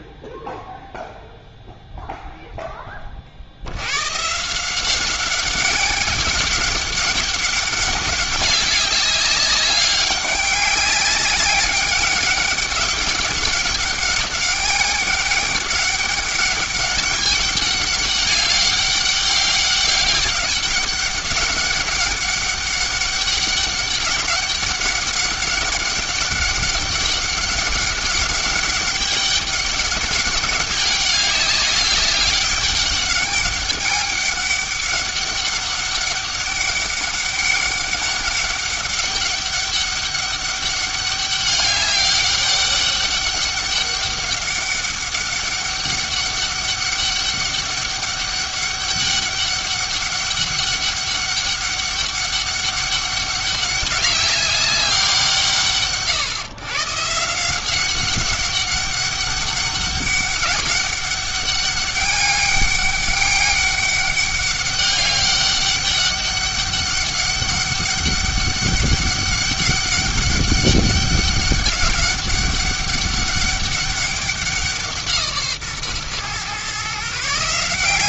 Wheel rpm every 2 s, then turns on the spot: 0, 10, 170, 190, 200, 200, 200, 200, 200, 200, 200, 200, 200, 200, 200, 200, 200, 200, 200, 200, 200, 200, 200, 200, 200, 200, 200, 200, 140, 200, 200, 200, 200, 200, 200, 200, 200, 180, 130.
none